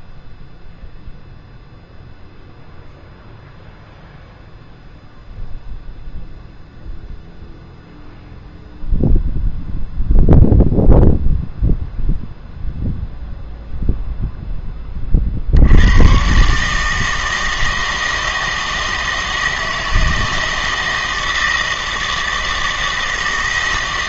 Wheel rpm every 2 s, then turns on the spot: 0, 0, 0, 0, 0, 0, 0, 10, 150, 160, 160, 160.
none